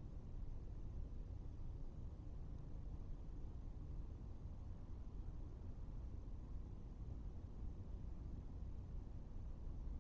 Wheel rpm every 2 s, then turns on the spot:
0, 0, 0, 0, 0.
none